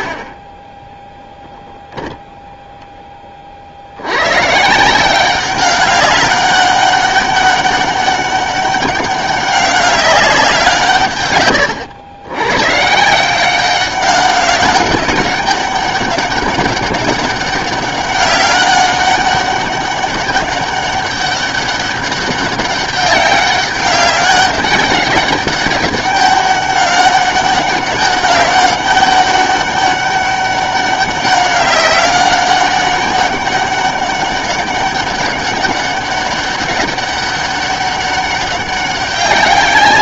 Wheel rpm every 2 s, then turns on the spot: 10, 0, 160, 200, 200, 160, 140, 200, 200, 200, 200, 200, 190, 200, 200, 200, 200, 200, 200, 200.
none